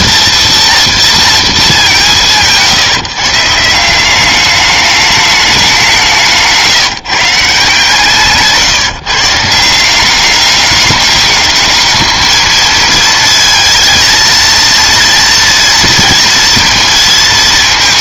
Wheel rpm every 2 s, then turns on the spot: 230, 150, 200, 160, 150, 200, 220, 230, 230.
none